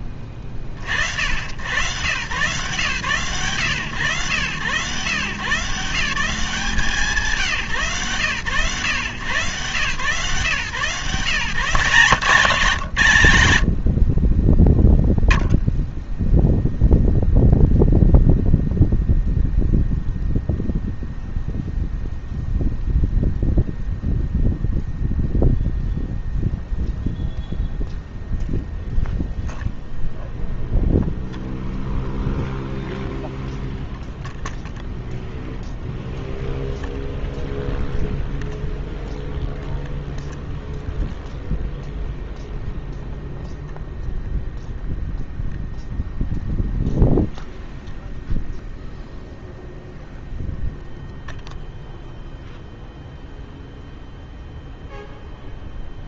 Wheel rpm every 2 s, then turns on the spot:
10, 100, 120, 160, 120, 140, 170, 20, 0, 0, 0, 0, 0, 0, 0, 0, 0, 0, 0, 0, 0, 0, 0, 0, 0, 0, 0, 0.
none